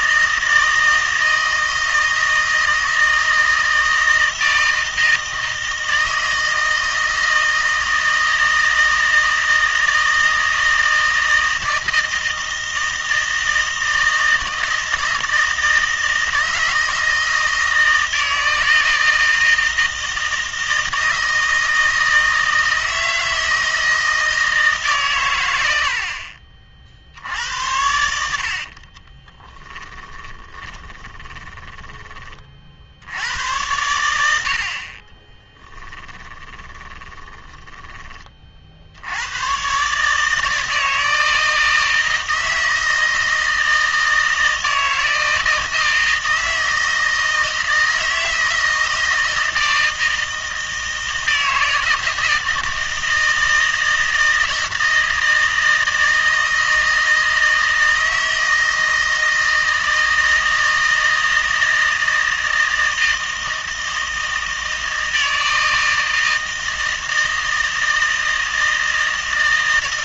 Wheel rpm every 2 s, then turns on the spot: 160, 160, 160, 160, 160, 160, 160, 160, 160, 160, 160, 160, 150, 50, 50, 20, 60, 50, 20, 60, 160, 160, 160, 160, 160, 160, 160, 160, 160, 160, 160, 160, 160, 160, 160.
28-32 36-38